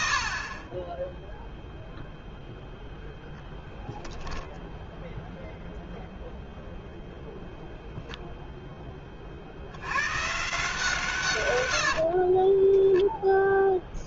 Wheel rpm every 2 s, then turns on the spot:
70, 0, 0, 0, 40, 120, 0.
none